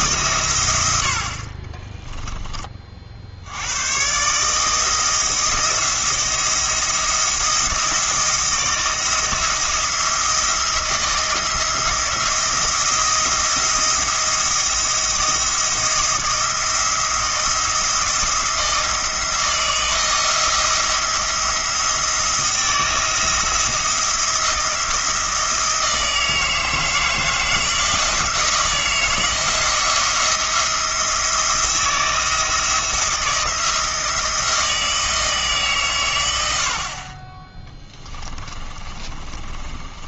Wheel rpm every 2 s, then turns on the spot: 90, 40, 160, 170, 170, 160, 170, 170, 170, 170, 170, 160, 160, 160, 160, 170, 170, 160, 50, 30.
38-40